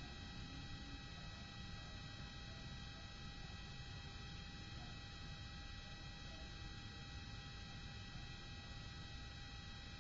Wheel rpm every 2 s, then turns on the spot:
0, 0, 0, 0, 0.
none